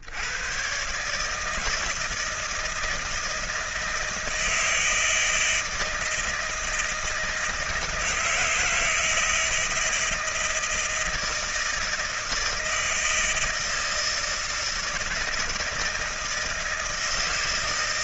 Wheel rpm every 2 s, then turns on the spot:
70, 160, 160, 160, 160, 160, 160, 160, 160.
none